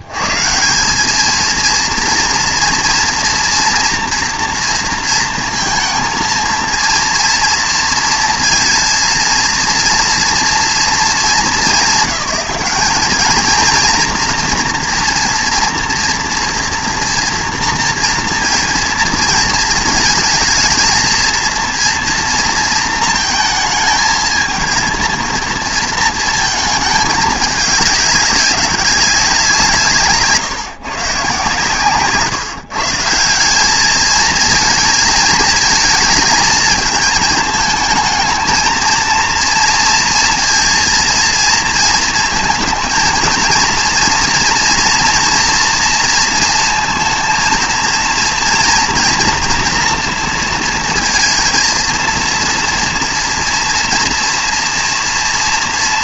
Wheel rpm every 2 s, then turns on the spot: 100, 230, 230, 230, 230, 230, 190, 230, 230, 230, 230, 230, 230, 220, 200, 160, 140, 220, 220, 230, 230, 230, 230, 230, 230, 230, 230, 230.
none